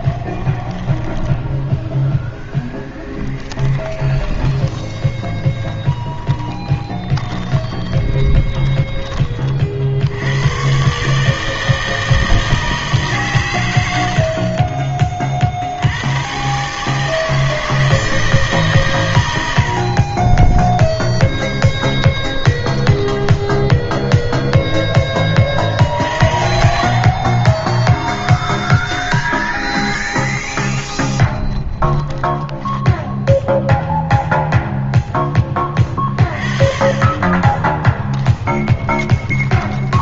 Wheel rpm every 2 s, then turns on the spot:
10, 10, 20, 20, 10, 120, 160, 30, 140, 150, 10, 10, 0, 50, 10, 20, 10, 0, 30, 10.
0-10 20-24 28-34 38-40